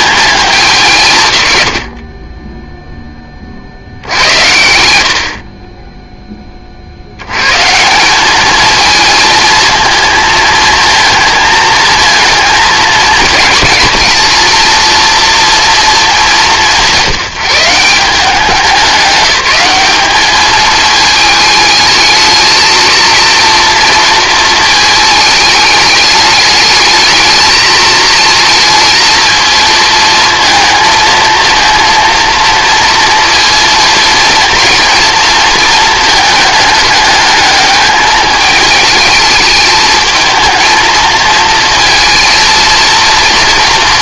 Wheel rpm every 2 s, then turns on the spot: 160, 10, 70, 90, 220, 230, 220, 230, 170, 200, 220, 230, 220, 220, 220, 230, 230, 230, 210, 210, 230, 230.
none